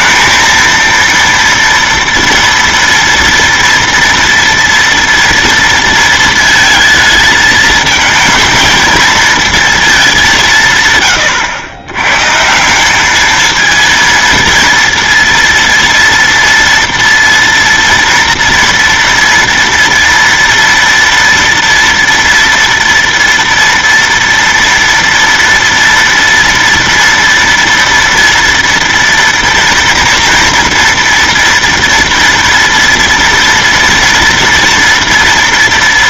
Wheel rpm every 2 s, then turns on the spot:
220, 230, 230, 230, 220, 190, 130, 230, 230, 230, 230, 230, 230, 230, 240, 230, 230, 230.
none